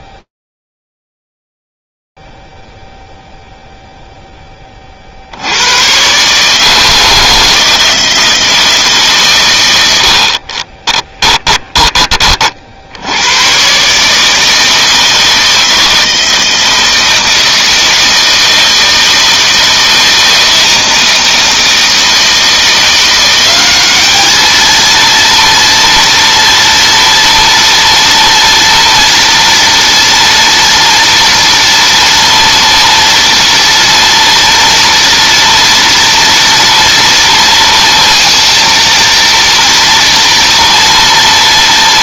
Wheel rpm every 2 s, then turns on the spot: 0, 0, 0, 130, 160, 60, 40, 160, 160, 160, 160, 160, 210, 230, 230, 230, 230, 230, 240, 230, 230.
none